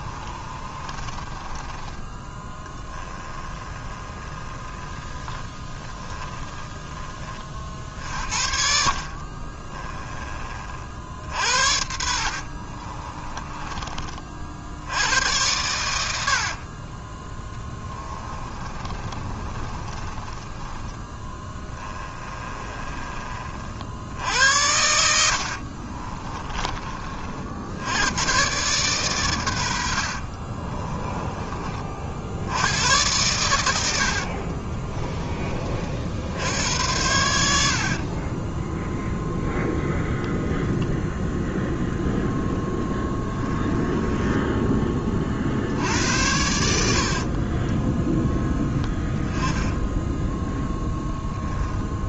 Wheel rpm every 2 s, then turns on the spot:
30, 10, 10, 20, 50, 60, 30, 80, 20, 20, 10, 30, 70, 40, 130, 20, 100, 20, 90, 0, 20, 10, 30, 60, 10, 0.
0-6 8-10 12-14 16-20 22-24 34-36 40-42